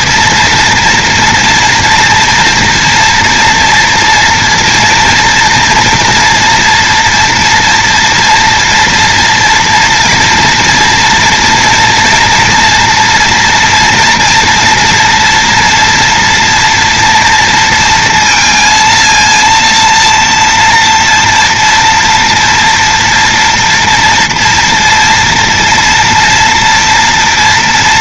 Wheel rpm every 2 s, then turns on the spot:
230, 230, 230, 230, 230, 230, 230, 230, 230, 230, 230, 230, 230, 230.
none